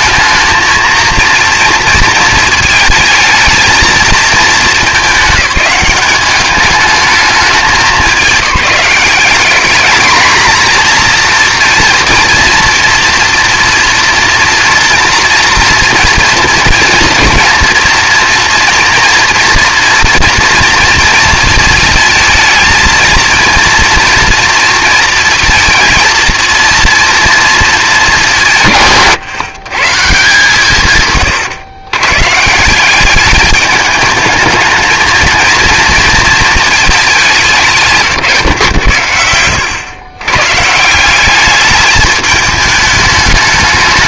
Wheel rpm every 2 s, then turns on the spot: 220, 220, 210, 210, 180, 220, 230, 240, 230, 230, 230, 220, 240, 230, 160, 150, 160, 220, 220, 130, 140, 210.
none